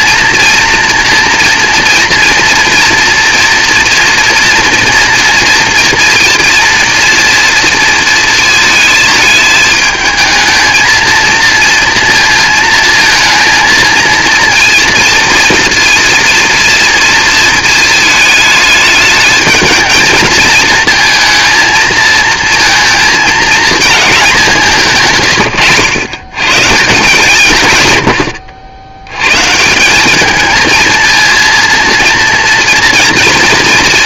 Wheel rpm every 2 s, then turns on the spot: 240, 230, 230, 230, 220, 220, 230, 230, 230, 210, 220, 230, 190, 140, 90, 230, 240.
none